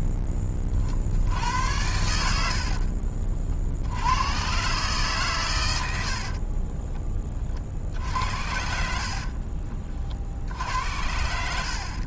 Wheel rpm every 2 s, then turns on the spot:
40, 60, 130, 20, 70, 70.
2-4 6-10